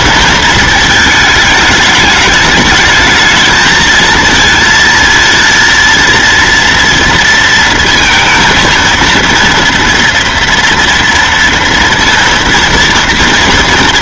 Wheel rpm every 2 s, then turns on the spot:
220, 210, 230, 230, 230, 230, 230.
none